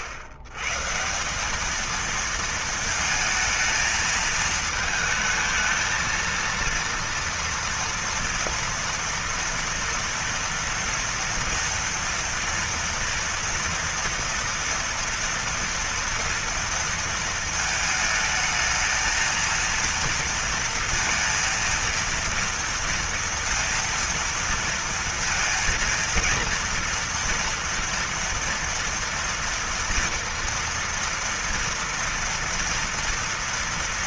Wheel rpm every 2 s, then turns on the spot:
110, 230, 220, 230, 230, 230, 230, 230, 230, 220, 230, 230, 230, 230, 230, 230, 230.
none